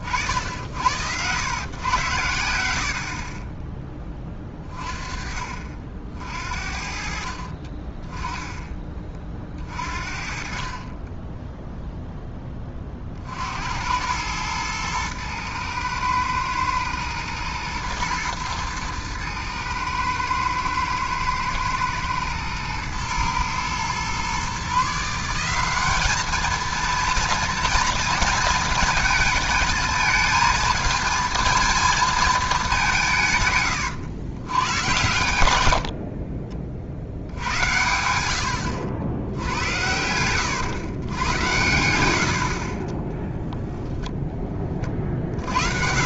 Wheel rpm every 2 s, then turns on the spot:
70, 70, 20, 50, 20, 40, 20, 110, 110, 110, 110, 110, 140, 230, 230, 220, 200, 110, 50, 70, 120, 40, 30.
2-4